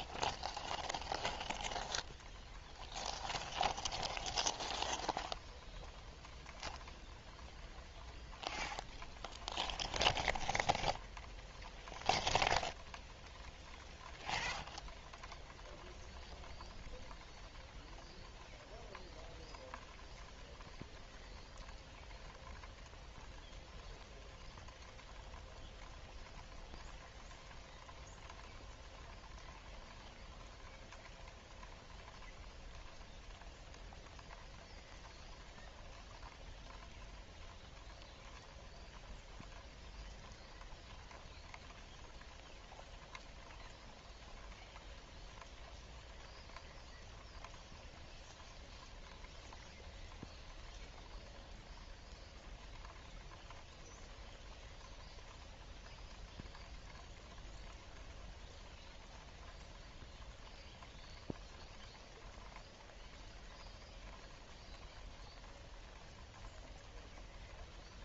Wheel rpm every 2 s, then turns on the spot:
0, 0, 0, 0, 0, 0, 0, 0, 0, 0, 0, 0, 0, 0, 0, 0, 0, 0, 0, 0, 0, 0, 0, 0, 0, 0, 0, 0, 0, 0, 0, 0, 0, 0.
none